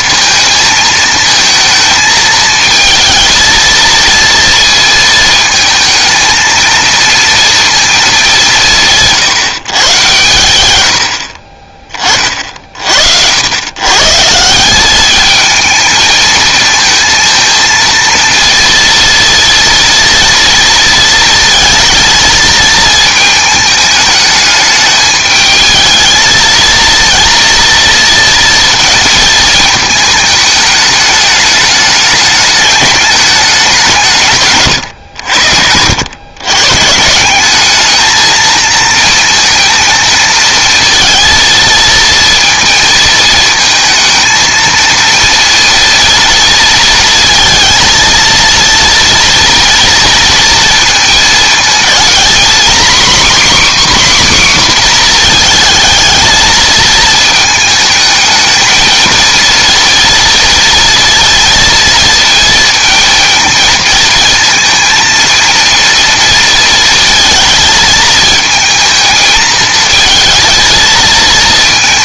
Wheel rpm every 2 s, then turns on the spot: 220, 220, 220, 230, 160, 100, 60, 190, 230, 230, 230, 220, 210, 230, 230, 210, 210, 120, 140, 230, 230, 230, 230, 230, 230, 230, 270, 250, 220, 220, 230, 230, 230, 230, 220, 220.
34-36